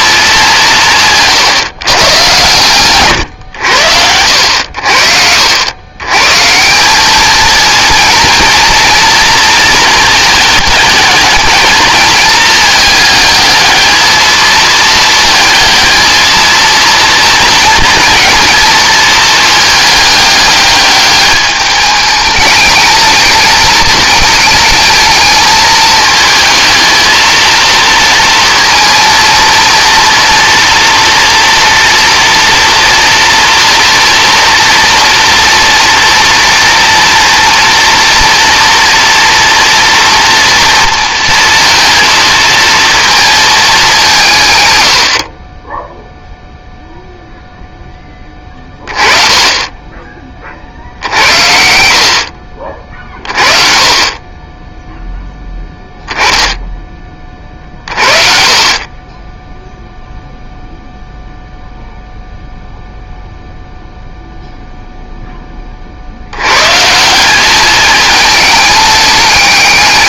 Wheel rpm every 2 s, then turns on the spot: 190, 110, 80, 160, 230, 220, 220, 220, 230, 220, 210, 210, 220, 220, 230, 230, 230, 230, 240, 230, 240, 230, 130, 0, 30, 40, 50, 20, 10, 40, 0, 0, 0, 120, 210.
none